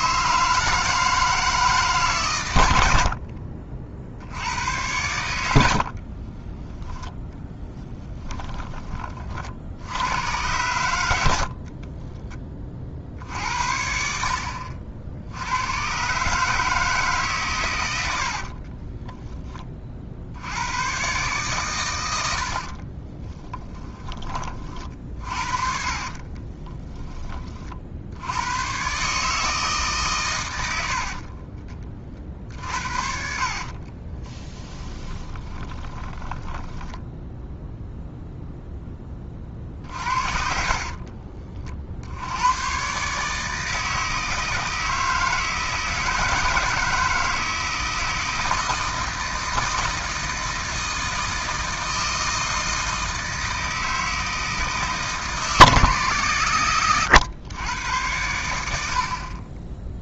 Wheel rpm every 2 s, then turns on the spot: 160, 100, 100, 20, 20, 90, 30, 50, 150, 50, 100, 50, 30, 20, 110, 100, 50, 10, 10, 0, 50, 110, 160, 160, 160, 160, 160, 160, 110, 80.
18-20 22-24 26-28 32-38 40-42